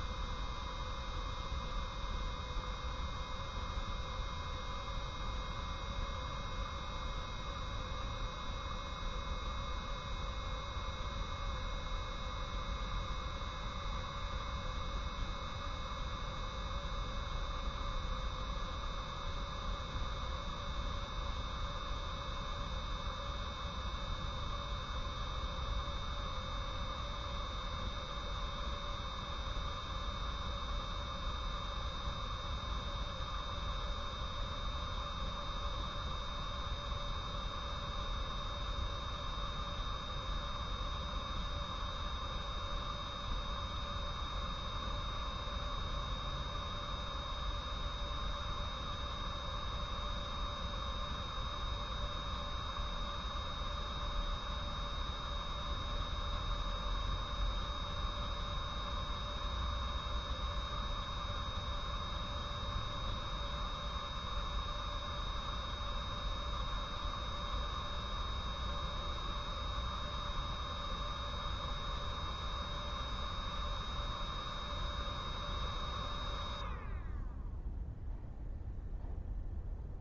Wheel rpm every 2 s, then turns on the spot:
0, 0, 0, 0, 0, 0, 0, 0, 0, 0, 0, 0, 0, 0, 0, 0, 0, 0, 0, 0, 0, 0, 0, 0, 0, 0, 0, 0, 0, 0, 0, 0, 0, 0, 0, 0, 0, 0, 0, 0.
none